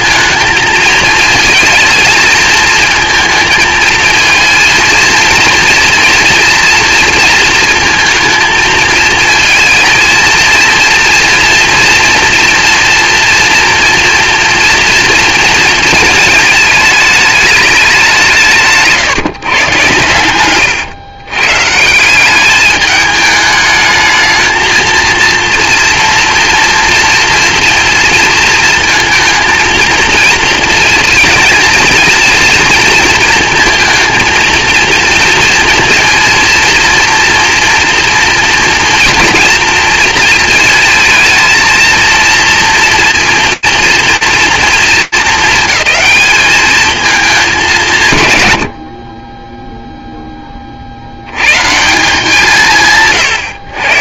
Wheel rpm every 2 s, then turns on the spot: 220, 220, 220, 230, 220, 230, 230, 230, 220, 160, 110, 210, 220, 230, 230, 230, 230, 230, 230, 230, 230, 230, 230, 210, 130, 30, 160.
20-22